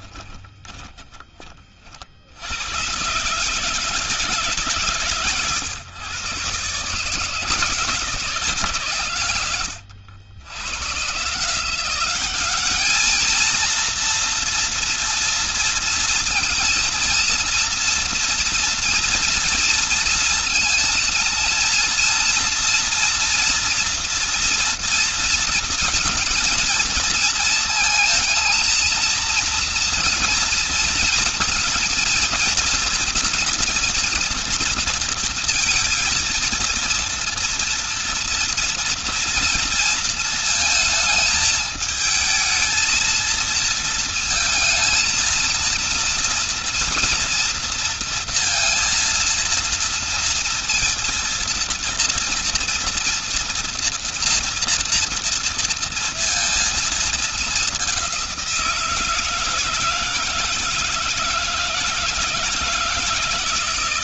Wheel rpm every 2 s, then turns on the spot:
20, 80, 150, 140, 150, 100, 200, 230, 230, 230, 230, 230, 230, 230, 230, 230, 230, 230, 230, 230, 220, 220, 230, 230, 230, 230, 230, 230, 230, 180, 160, 160.
0-2